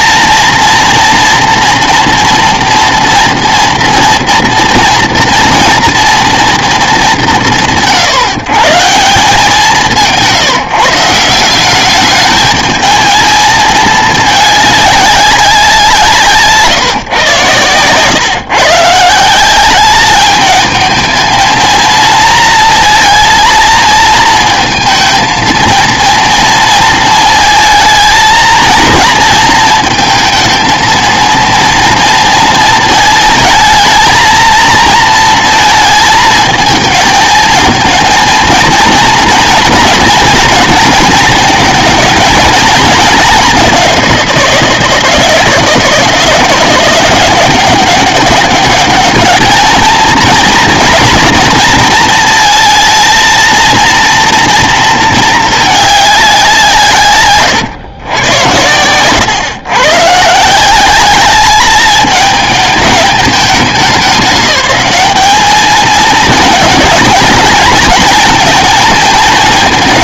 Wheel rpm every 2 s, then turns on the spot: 230, 240, 230, 220, 140, 170, 220, 210, 140, 140, 220, 230, 220, 230, 230, 230, 220, 230, 220, 230, 230, 220, 170, 170, 200, 230, 230, 230, 170, 110, 170, 220, 210, 220, 230.
58-60